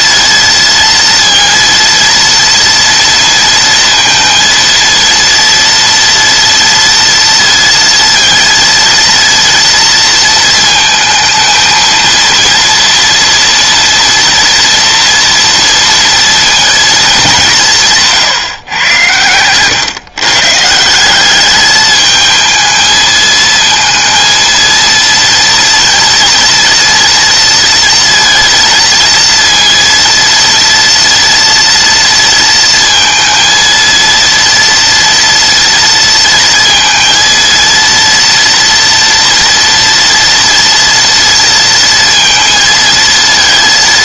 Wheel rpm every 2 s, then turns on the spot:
230, 230, 230, 230, 230, 230, 230, 230, 220, 120, 160, 220, 230, 230, 230, 230, 230, 230, 230, 230, 230, 230.
none